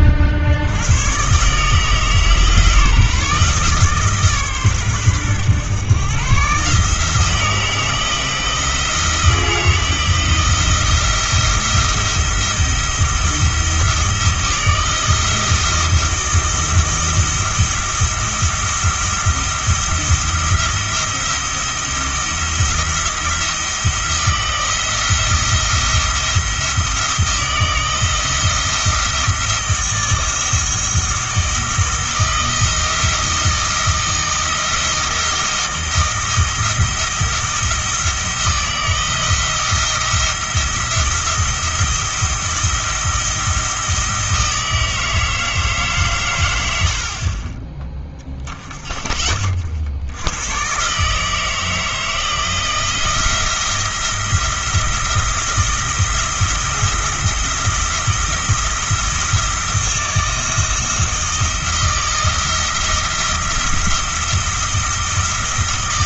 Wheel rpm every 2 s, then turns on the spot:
90, 150, 130, 150, 160, 170, 170, 170, 170, 170, 170, 170, 170, 160, 170, 170, 170, 170, 170, 170, 170, 170, 160, 70, 20, 130, 170, 170, 170, 170, 160, 170, 170.
none